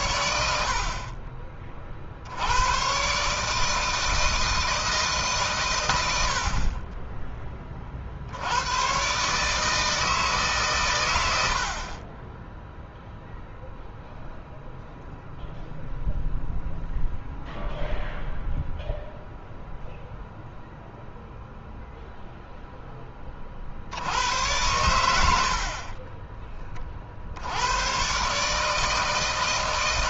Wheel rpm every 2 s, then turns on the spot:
60, 90, 160, 70, 90, 150, 10, 0, 0, 0, 0, 0, 90, 30, 150.
none